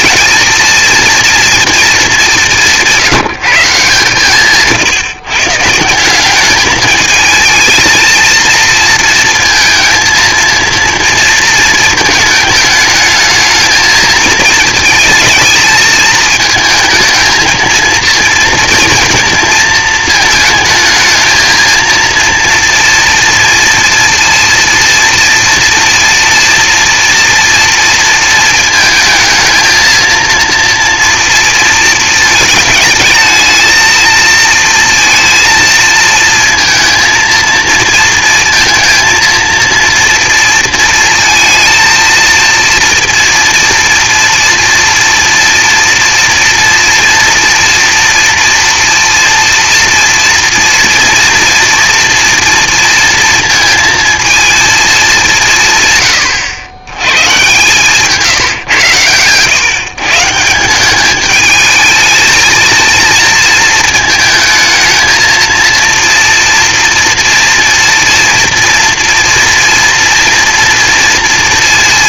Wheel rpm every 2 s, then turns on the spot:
230, 190, 150, 210, 230, 230, 210, 220, 220, 230, 220, 230, 230, 230, 220, 230, 220, 230, 230, 230, 230, 230, 230, 230, 230, 230, 230, 220, 100, 130, 180, 230, 220, 240, 230, 230.
none